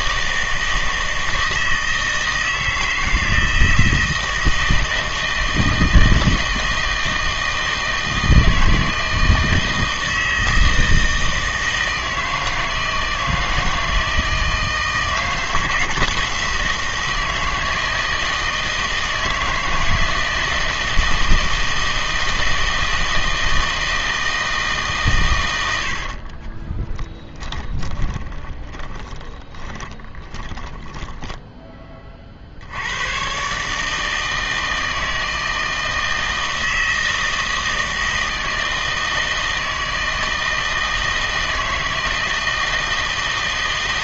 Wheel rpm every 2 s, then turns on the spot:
160, 160, 160, 160, 160, 160, 160, 160, 160, 160, 160, 160, 160, 20, 20, 10, 80, 160, 160, 160, 160, 160.
26-32